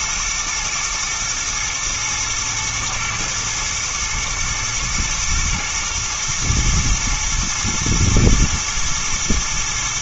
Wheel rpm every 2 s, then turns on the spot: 110, 110, 110, 120, 110.
none